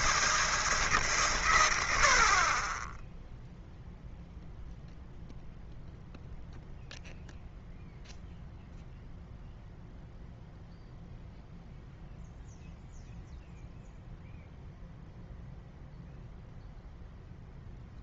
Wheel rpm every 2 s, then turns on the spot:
160, 20, 0, 0, 0, 0, 0, 0, 0.
none